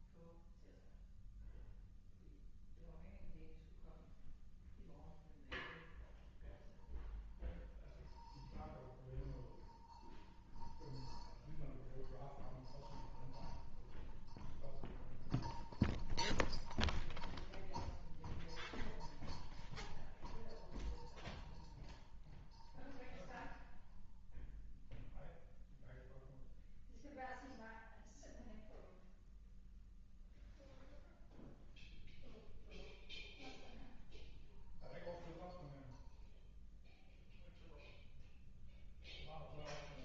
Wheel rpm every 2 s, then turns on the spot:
0, 0, 0, 0, 0, 0, 0, 0, 0, 0, 0, 0, 0, 0, 0, 0, 0, 0, 0, 0.
none